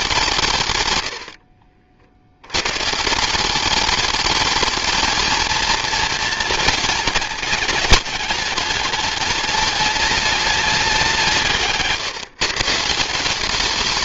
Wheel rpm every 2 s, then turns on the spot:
120, 130, 220, 220, 210, 200, 170.
none